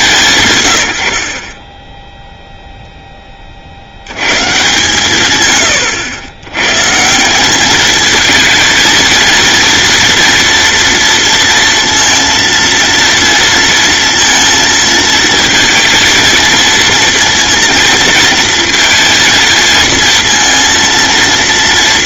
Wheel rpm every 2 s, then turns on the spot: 90, 0, 150, 140, 220, 230, 230, 230, 230, 230, 230.
none